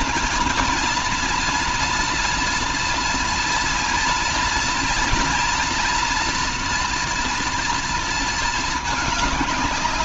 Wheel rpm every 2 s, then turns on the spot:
230, 230, 230, 240, 220.
none